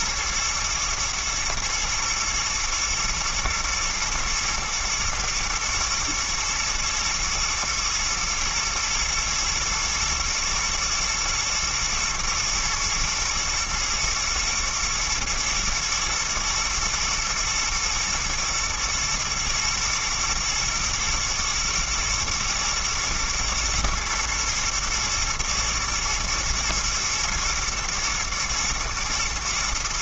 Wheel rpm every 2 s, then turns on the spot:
120, 110, 120, 110, 110, 110, 110, 120, 110, 110, 110, 110, 110, 110, 110.
none